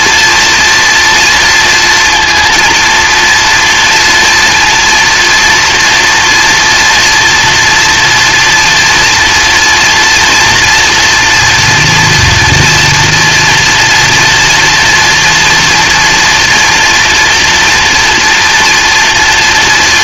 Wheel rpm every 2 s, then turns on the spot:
240, 230, 230, 240, 230, 240, 230, 230, 230, 230.
none